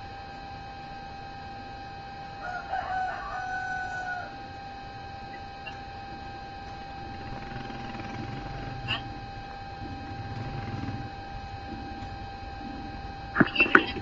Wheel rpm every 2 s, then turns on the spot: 0, 0, 0, 0, 0, 0, 0.
none